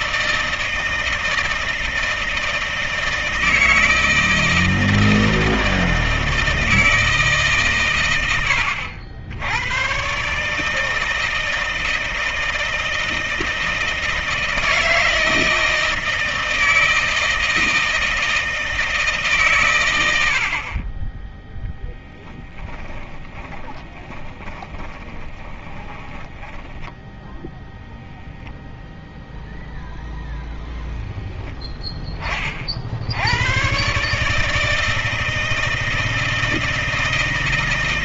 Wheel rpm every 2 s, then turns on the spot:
160, 160, 160, 160, 80, 160, 160, 160, 160, 150, 30, 20, 30, 10, 0, 10, 70, 160, 160.
22-26